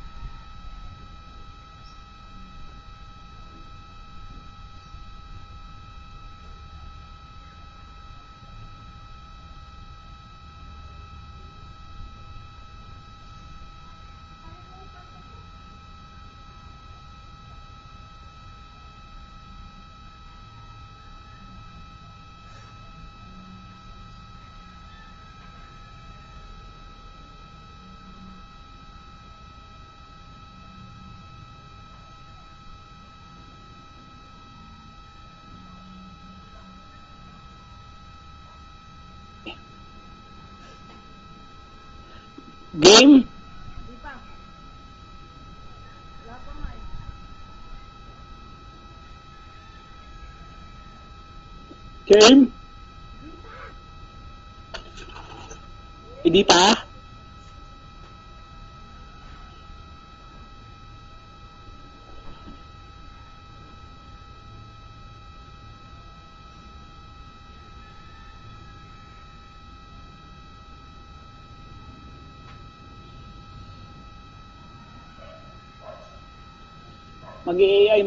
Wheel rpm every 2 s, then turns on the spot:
0, 0, 0, 0, 0, 0, 0, 0, 0, 0, 0, 0, 0, 0, 0, 0, 0, 0, 0, 0, 0, 0, 0, 0, 0, 0, 0, 0, 0, 0, 0, 0, 0, 0, 0, 0, 0, 0, 0.
none